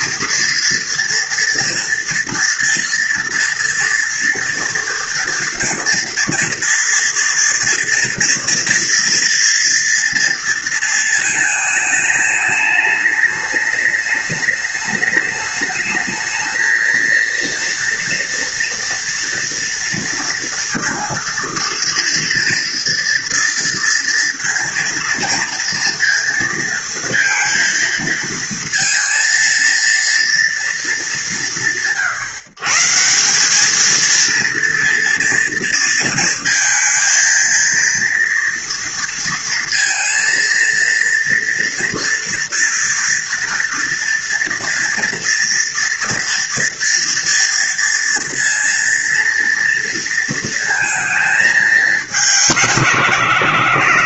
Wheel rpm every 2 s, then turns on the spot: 230, 230, 230, 230, 230, 230, 210, 210, 230, 230, 230, 230, 230, 230, 230, 180, 150, 230, 230, 230, 230, 230, 240, 240, 230, 220, 180.
none